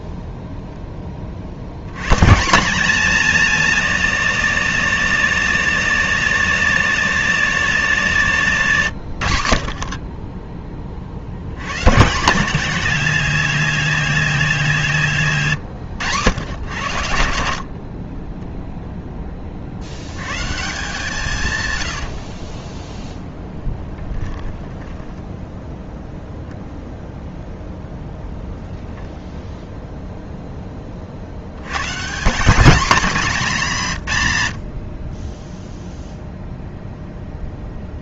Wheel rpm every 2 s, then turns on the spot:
10, 210, 200, 200, 140, 30, 190, 180, 100, 0, 140, 10, 10, 0, 0, 10, 190, 60, 0.
22-26